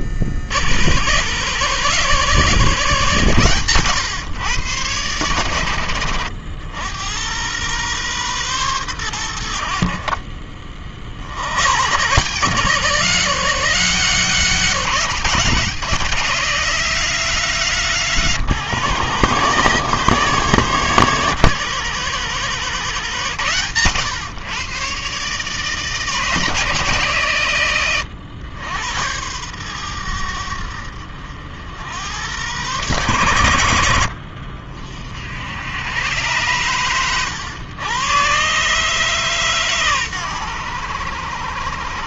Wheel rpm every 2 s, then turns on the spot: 80, 150, 110, 80, 110, 40, 150, 170, 180, 140, 140, 140, 130, 150, 100, 70, 120, 50, 110, 140, 100.
none